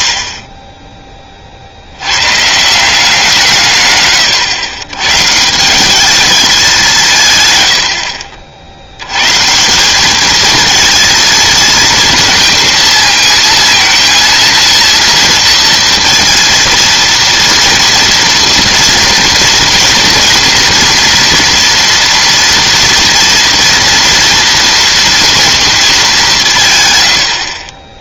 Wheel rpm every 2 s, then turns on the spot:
20, 170, 120, 180, 100, 220, 230, 230, 230, 230, 230, 240, 230, 100.
none